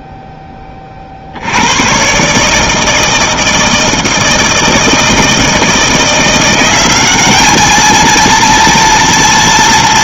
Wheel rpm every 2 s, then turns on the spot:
10, 150, 160, 180, 230.
none